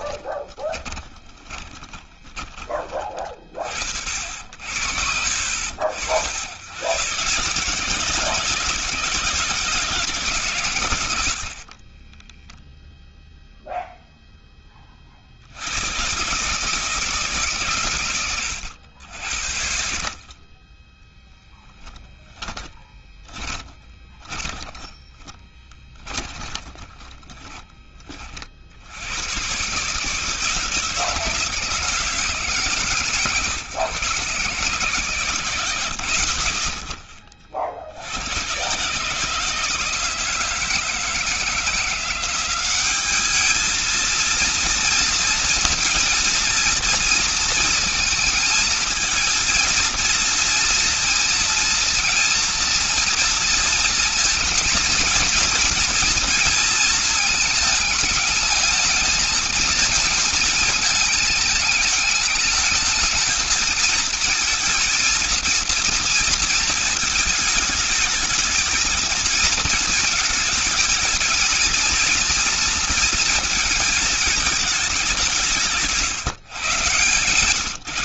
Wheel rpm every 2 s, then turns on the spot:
20, 30, 70, 110, 160, 110, 0, 40, 150, 80, 10, 20, 10, 20, 100, 160, 140, 130, 40, 140, 160, 200, 230, 230, 220, 230, 230, 230, 230, 220, 220, 210, 220, 230, 220, 230, 230, 210, 150.
0-2 20-28